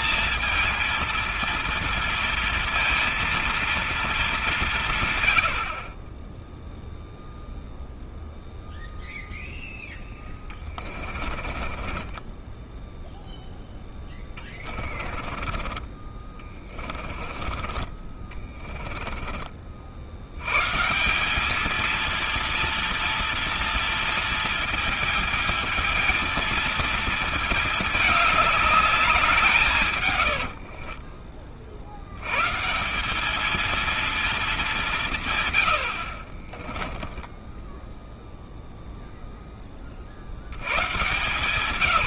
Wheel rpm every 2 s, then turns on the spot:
230, 230, 180, 0, 0, 20, 0, 20, 20, 20, 140, 230, 220, 230, 210, 60, 160, 190, 20, 0, 120.
10-12 14-20 30-32 36-38